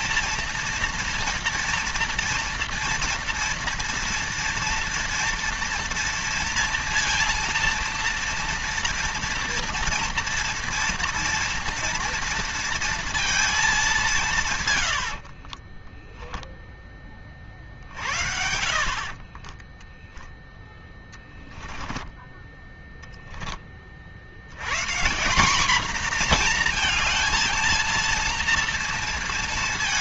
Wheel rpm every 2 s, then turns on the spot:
230, 230, 230, 230, 230, 230, 230, 140, 10, 60, 0, 10, 110, 230, 230.
18-20